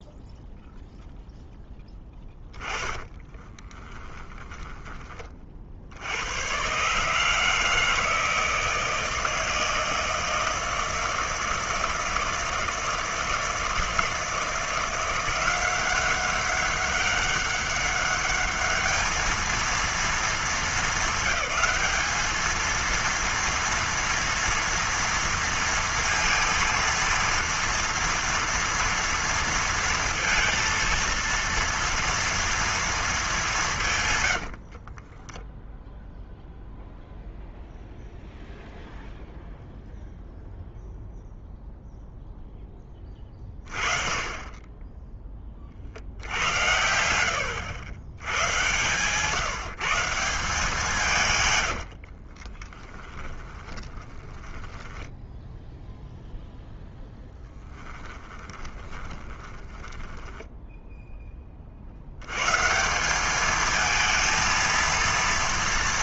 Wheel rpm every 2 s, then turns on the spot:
0, 20, 10, 120, 160, 160, 160, 170, 190, 210, 220, 220, 230, 230, 240, 230, 230, 70, 0, 0, 0, 10, 20, 80, 110, 170, 30, 10, 0, 20, 10, 140, 230.
2-6 34-36 52-56 58-62